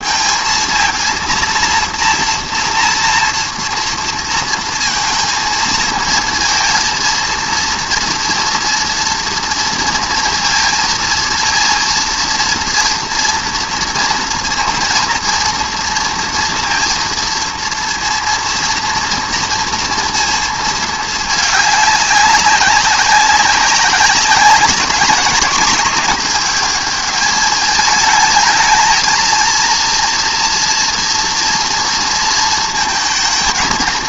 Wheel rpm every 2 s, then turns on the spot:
230, 230, 230, 230, 230, 230, 230, 230, 230, 230, 220, 200, 200, 220, 220, 230, 220.
none